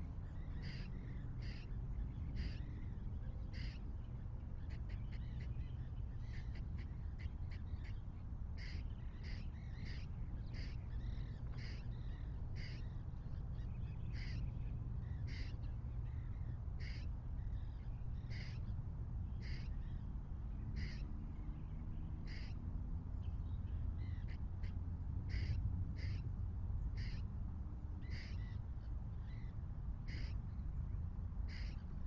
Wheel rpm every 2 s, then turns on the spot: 0, 0, 0, 0, 0, 0, 0, 0, 0, 0, 0, 0, 0, 0, 0, 0.
none